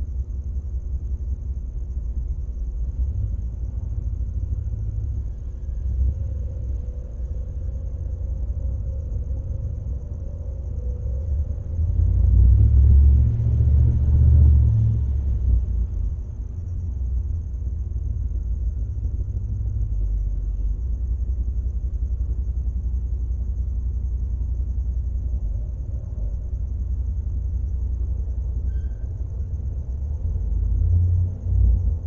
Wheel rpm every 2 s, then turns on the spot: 0, 0, 0, 0, 0, 0, 0, 0, 0, 0, 0, 0, 0, 0, 0, 0.
none